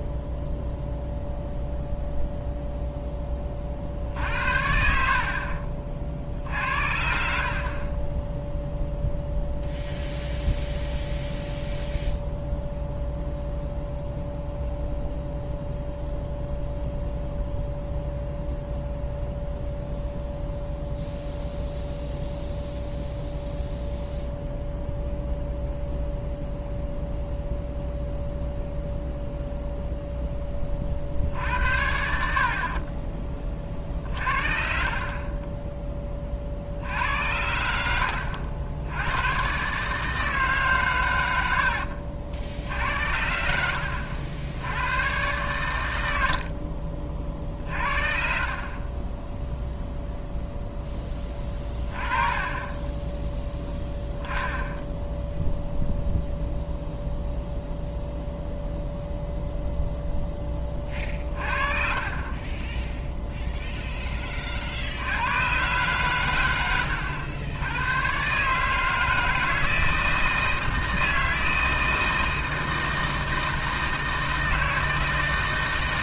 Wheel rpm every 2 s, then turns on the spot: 0, 0, 60, 60, 0, 0, 0, 0, 0, 0, 0, 0, 0, 0, 0, 30, 40, 40, 60, 90, 150, 60, 90, 50, 30, 0, 20, 0, 0, 0, 20, 10, 60, 90, 150, 160, 160, 160.
52-54